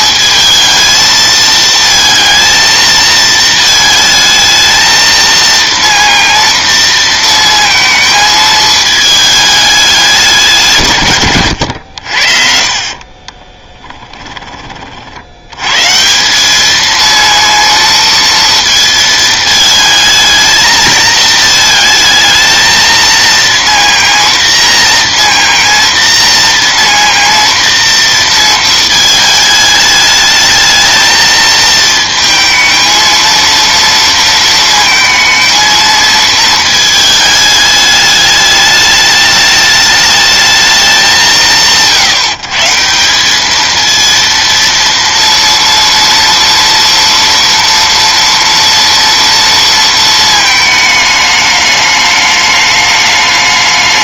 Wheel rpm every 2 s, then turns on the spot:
220, 230, 220, 230, 220, 140, 50, 30, 210, 230, 220, 220, 230, 230, 220, 220, 230, 230, 220, 210, 210, 160, 230, 230, 230, 220, 210.
12-14